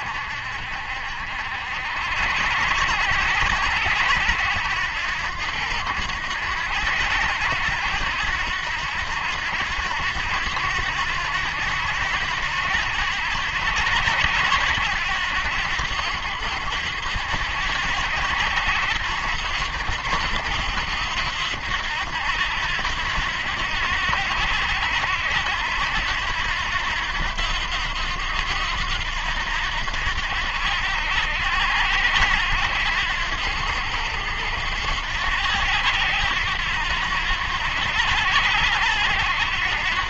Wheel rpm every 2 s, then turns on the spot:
60, 80, 80, 80, 80, 90, 90, 90, 80, 90, 90, 80, 90, 80, 90, 80, 90, 80, 80, 90.
none